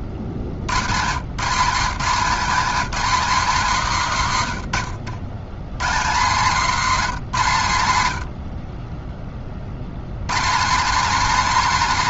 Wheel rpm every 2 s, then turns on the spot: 90, 210, 100, 180, 0, 190.
none